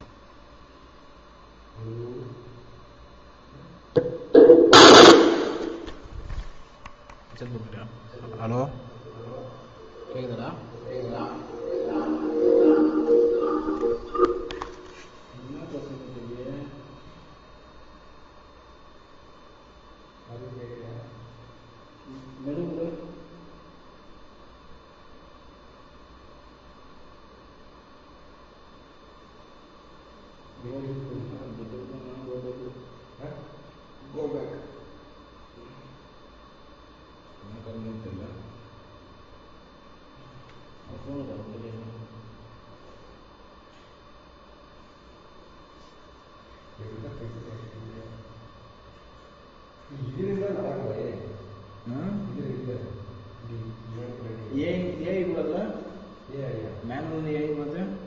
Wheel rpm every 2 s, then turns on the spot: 0, 0, 0, 0, 0, 0, 0, 0, 0, 0, 0, 0, 0, 0, 0, 0, 0, 0, 0, 0, 0, 0, 0, 0, 0, 0, 0, 0, 0.
none